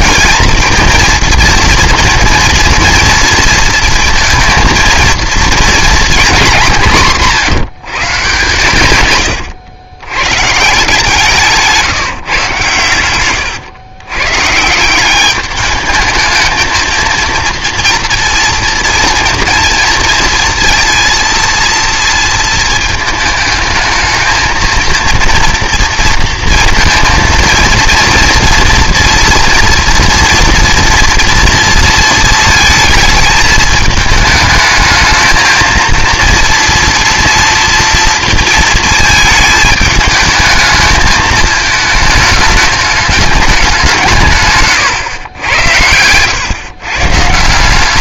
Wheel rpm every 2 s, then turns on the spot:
230, 240, 230, 200, 130, 150, 120, 150, 220, 230, 230, 230, 230, 230, 230, 230, 220, 210, 230, 230, 220, 210, 140, 130.
44-46